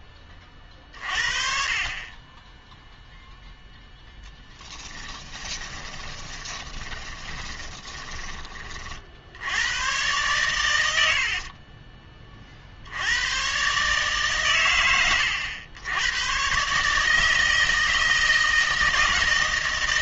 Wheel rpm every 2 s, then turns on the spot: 40, 10, 10, 20, 40, 100, 60, 110, 150, 160.
4-8